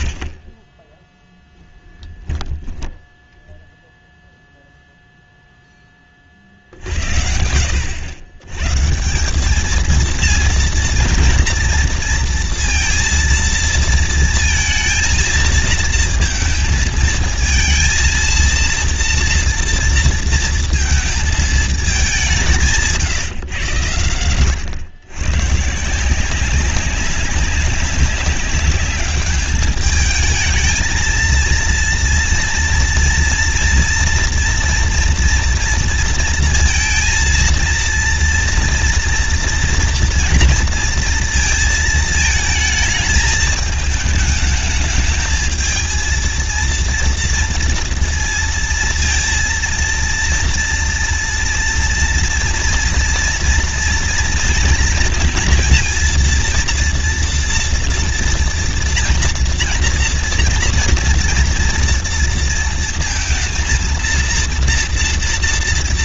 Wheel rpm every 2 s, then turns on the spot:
80, 10, 0, 40, 100, 230, 230, 230, 230, 230, 230, 190, 100, 180, 200, 220, 230, 230, 230, 230, 230, 220, 210, 230, 230, 230, 230, 230, 230, 230, 230, 230, 230.
none